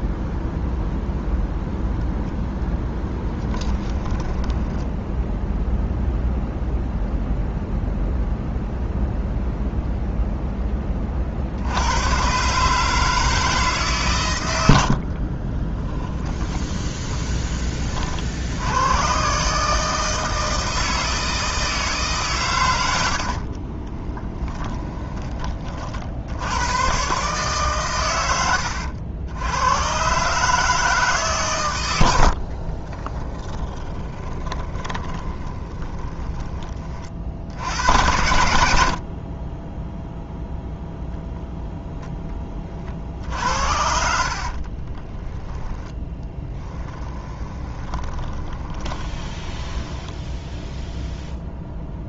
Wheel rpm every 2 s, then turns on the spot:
0, 20, 10, 0, 0, 10, 150, 80, 20, 90, 160, 100, 10, 110, 90, 160, 40, 20, 20, 60, 0, 30, 40, 10, 20, 0.
2-6 16-18 32-36 44-50